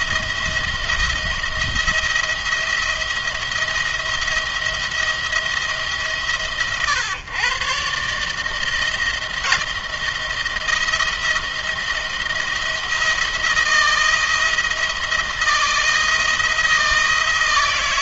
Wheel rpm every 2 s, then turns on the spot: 170, 170, 170, 130, 160, 170, 170, 170, 170.
none